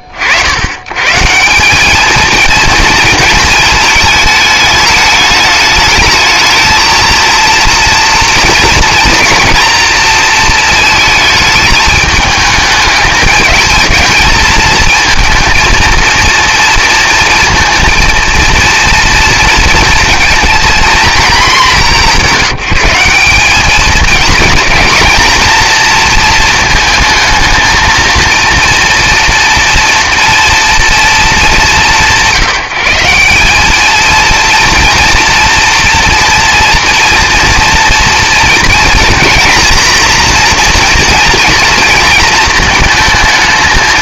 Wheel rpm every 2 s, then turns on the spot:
50, 220, 210, 220, 240, 230, 220, 230, 230, 230, 230, 180, 220, 230, 230, 240, 160, 230, 240, 240, 240, 230.
none